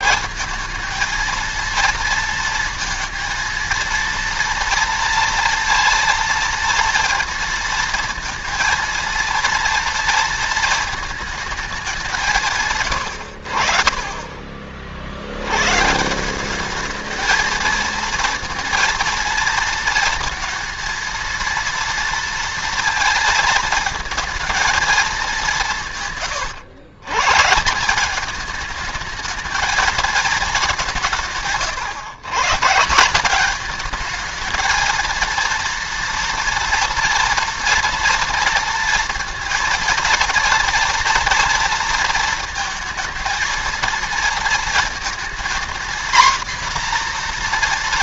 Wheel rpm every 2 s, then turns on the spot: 220, 230, 230, 230, 230, 220, 140, 50, 210, 230, 230, 230, 220, 110, 210, 200, 160, 220, 230, 230, 230, 220, 230, 240.
none